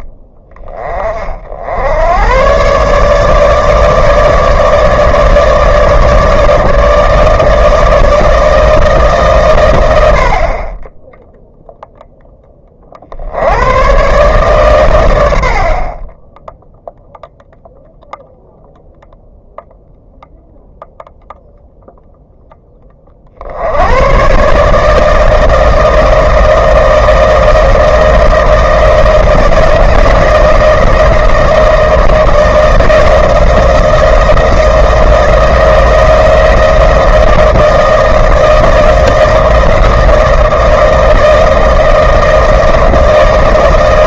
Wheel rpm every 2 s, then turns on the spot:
20, 130, 160, 150, 160, 30, 20, 130, 0, 0, 0, 20, 150, 160, 160, 160, 160, 170, 170, 160, 160, 160.
none